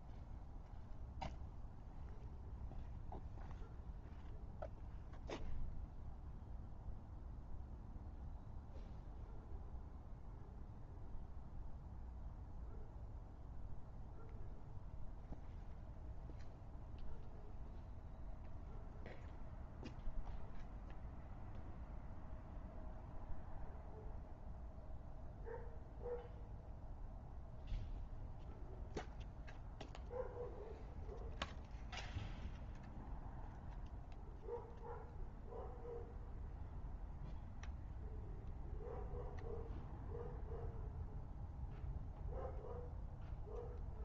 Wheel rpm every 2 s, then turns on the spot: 0, 0, 0, 0, 0, 0, 0, 0, 0, 0, 0, 0, 0, 0, 0, 0, 0, 0, 0, 0, 0, 0.
none